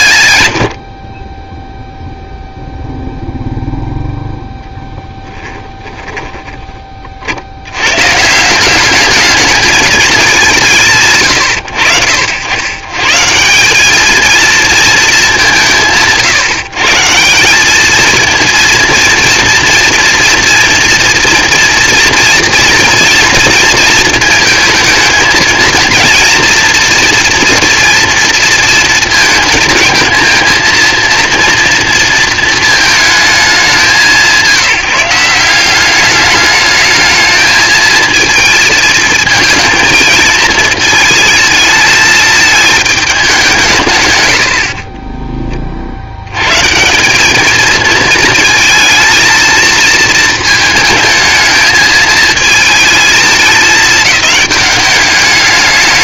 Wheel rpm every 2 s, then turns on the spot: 80, 0, 10, 20, 180, 170, 100, 220, 150, 230, 230, 230, 230, 240, 230, 230, 220, 170, 210, 220, 220, 220, 60, 150, 220, 220, 220, 200.
none